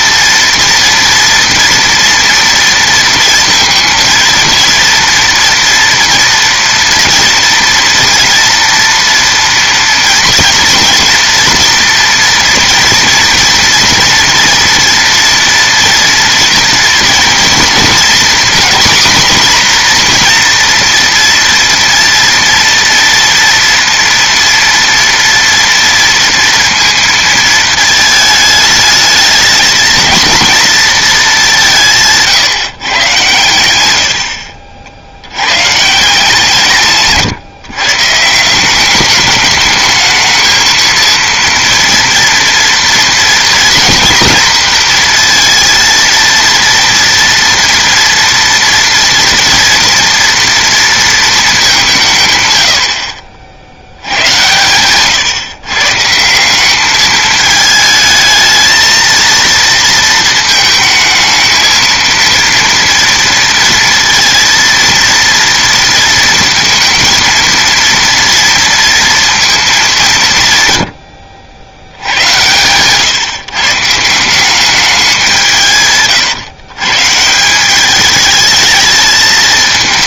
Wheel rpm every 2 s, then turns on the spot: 230, 230, 230, 230, 240, 240, 230, 230, 230, 250, 240, 230, 230, 230, 210, 230, 120, 60, 140, 190, 230, 230, 230, 230, 230, 230, 100, 120, 190, 220, 220, 230, 230, 230, 230, 110, 110, 200, 130, 220.
none